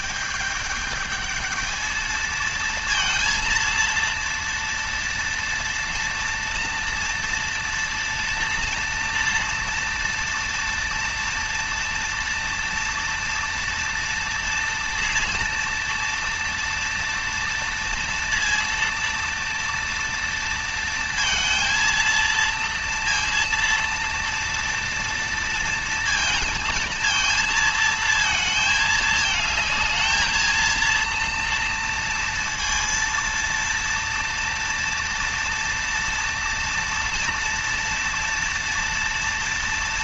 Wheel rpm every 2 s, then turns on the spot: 210, 230, 230, 230, 230, 240, 230, 230, 230, 230, 230, 230, 230, 230, 220, 230, 230, 230, 230, 230.
none